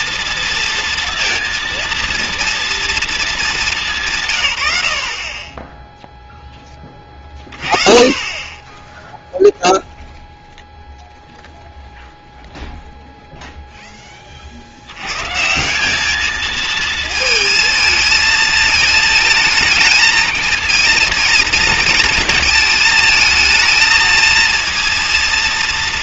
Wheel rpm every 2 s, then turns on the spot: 230, 230, 110, 10, 20, 0, 0, 40, 220, 220, 220, 220, 230.
none